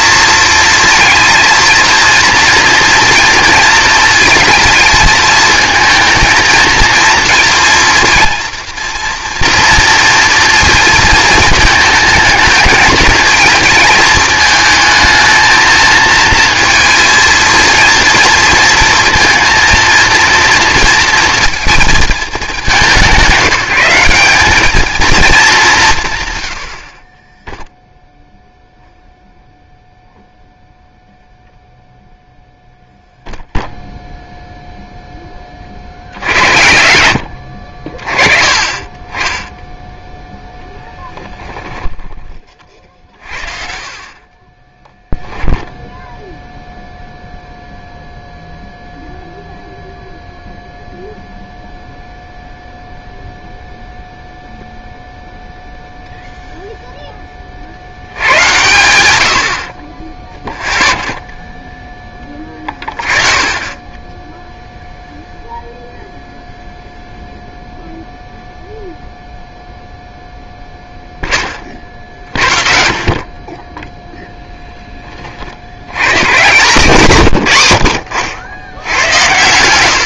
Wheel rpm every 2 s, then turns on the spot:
230, 230, 220, 230, 230, 230, 220, 220, 230, 230, 230, 200, 210, 80, 0, 0, 0, 0, 80, 30, 0, 40, 20, 0, 0, 0, 0, 0, 0, 90, 0, 20, 0, 0, 0, 0, 40, 10, 140, 90.
44-46